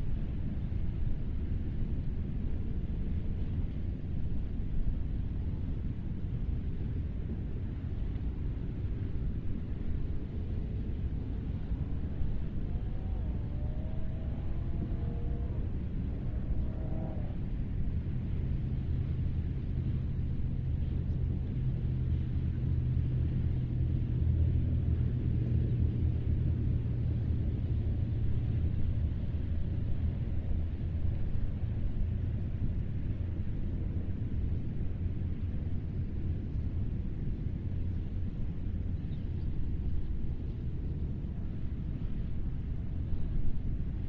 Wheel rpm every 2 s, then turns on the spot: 0, 0, 0, 0, 0, 0, 0, 0, 0, 0, 0, 0, 0, 0, 0, 0, 0, 0, 0, 0, 0, 0.
none